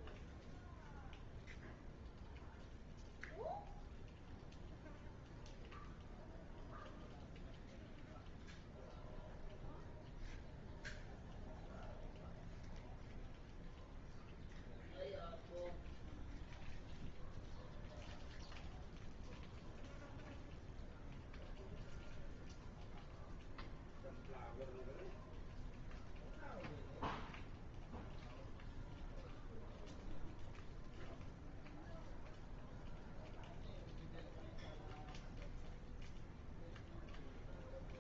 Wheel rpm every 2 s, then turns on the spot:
0, 0, 0, 0, 0, 0, 0, 0, 0, 0, 0, 0, 0, 0, 0, 0, 0, 0, 0.
none